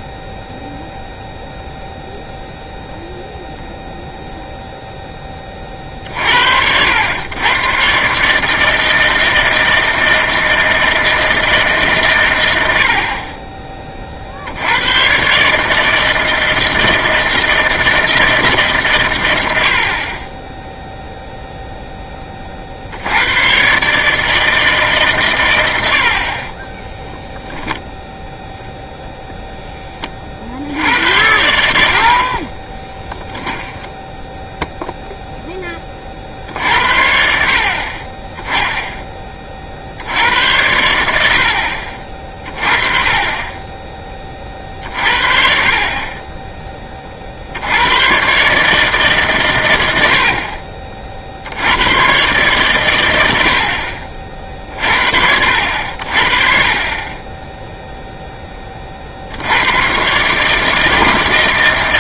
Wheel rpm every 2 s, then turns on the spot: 0, 0, 10, 90, 160, 160, 60, 100, 160, 140, 0, 70, 150, 20, 0, 80, 20, 0, 60, 10, 90, 30, 40, 30, 150, 50, 110, 60, 30, 30, 160.
26-28 32-34